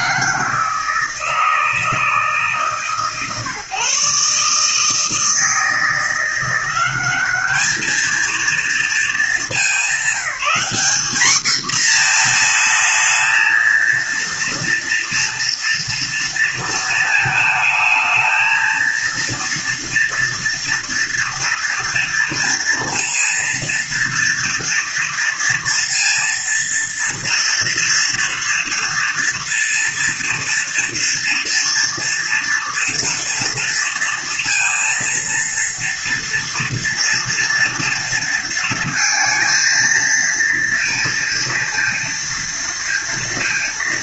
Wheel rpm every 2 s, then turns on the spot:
160, 150, 150, 180, 230, 210, 220, 230, 230, 220, 230, 230, 230, 230, 230, 230, 230, 230, 230, 220, 230, 230.
none